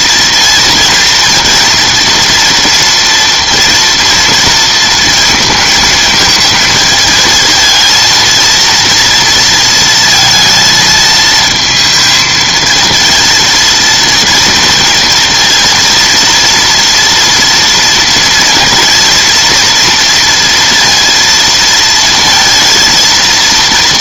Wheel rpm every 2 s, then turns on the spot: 230, 230, 230, 220, 230, 220, 220, 230, 230, 230, 230, 230.
none